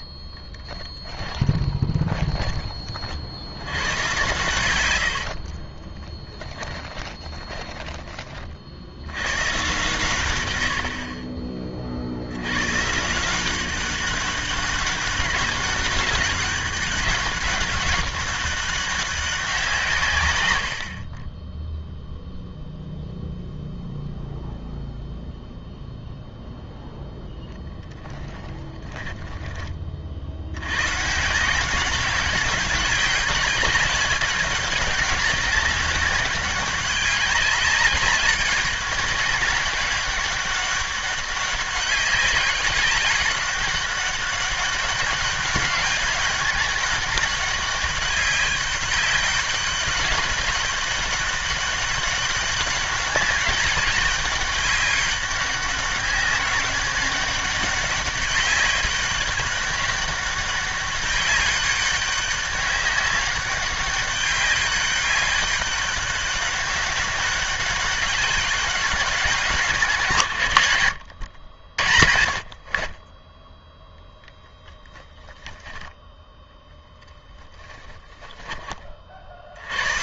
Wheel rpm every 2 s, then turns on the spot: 10, 20, 100, 10, 40, 90, 120, 200, 200, 200, 90, 0, 0, 0, 20, 100, 190, 190, 190, 200, 200, 200, 190, 200, 200, 200, 200, 200, 200, 200, 200, 200, 200, 200, 200, 110, 50, 10, 0, 20.
0-4 6-8 28-30